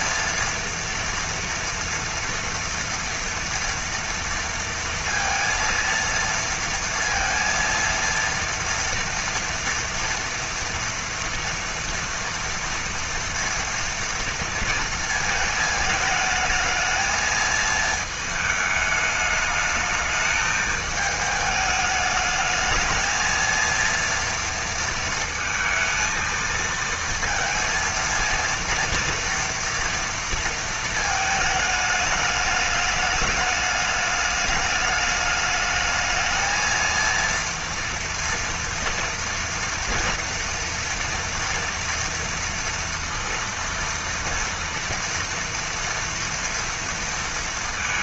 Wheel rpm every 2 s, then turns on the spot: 230, 230, 230, 230, 230, 230, 230, 230, 220, 210, 220, 220, 220, 230, 230, 220, 210, 210, 230, 230, 230, 230, 230, 230.
none